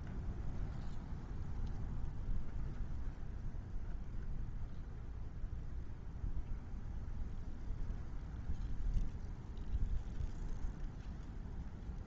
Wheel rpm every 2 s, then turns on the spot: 0, 0, 0, 0, 0, 0.
none